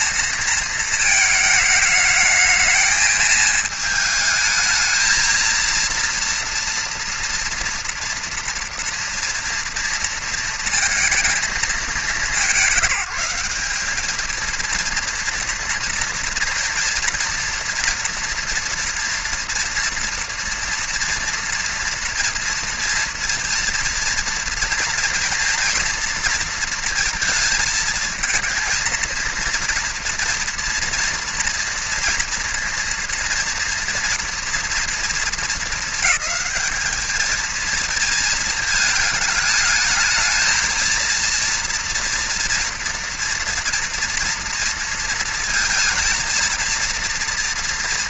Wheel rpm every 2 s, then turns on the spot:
230, 220, 220, 230, 230, 230, 190, 220, 230, 230, 230, 230, 230, 230, 220, 230, 240, 230, 210, 220, 230, 230, 230, 230.
none